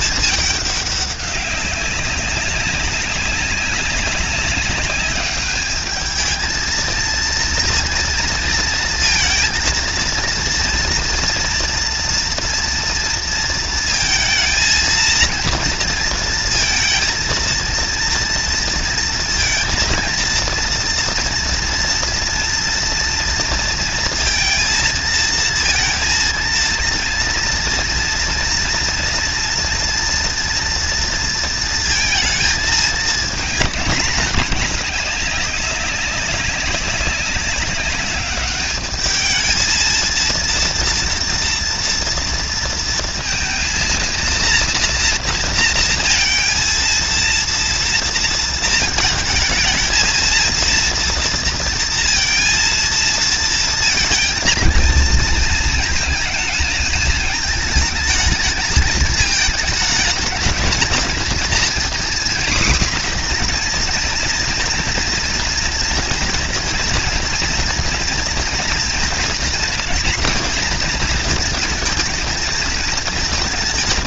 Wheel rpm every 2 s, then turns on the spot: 200, 190, 200, 230, 230, 230, 230, 230, 230, 230, 230, 230, 220, 230, 230, 230, 220, 200, 200, 210, 230, 230, 240, 230, 220, 230, 230, 230, 220, 220, 220, 250, 230, 230, 230, 230, 220.
none